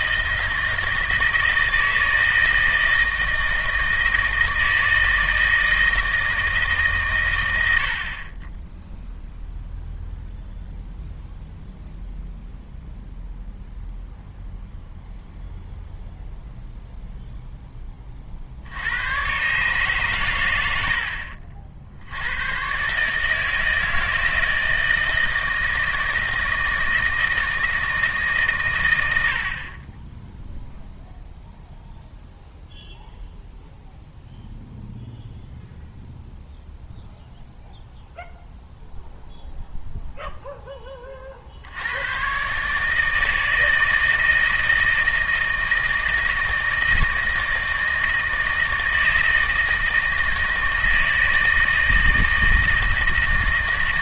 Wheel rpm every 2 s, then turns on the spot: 160, 160, 160, 150, 10, 0, 0, 0, 0, 60, 100, 120, 160, 160, 120, 0, 0, 0, 0, 0, 10, 140, 160, 160, 160, 160, 160.
none